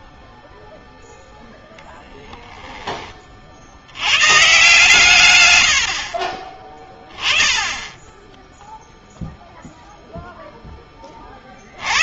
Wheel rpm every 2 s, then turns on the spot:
0, 60, 100, 20, 0, 50.
none